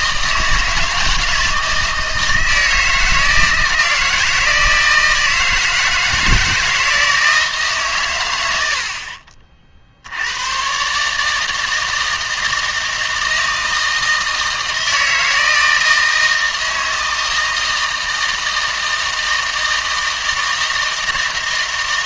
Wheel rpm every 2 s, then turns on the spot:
160, 160, 160, 160, 80, 120, 160, 160, 160, 160, 160.
none